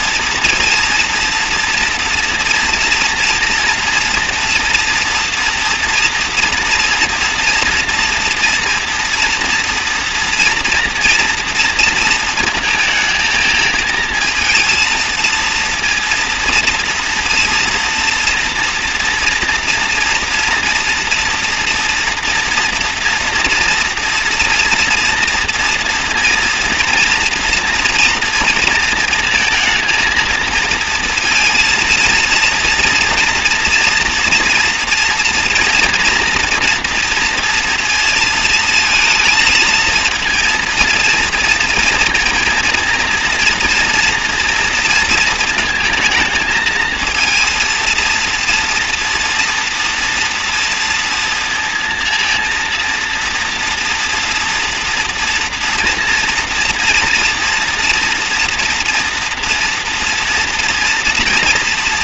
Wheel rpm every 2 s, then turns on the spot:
230, 230, 230, 230, 240, 230, 230, 230, 230, 230, 230, 230, 230, 230, 220, 230, 230, 230, 230, 220, 230, 230, 230, 220, 230, 230, 230, 230, 230, 230, 230.
none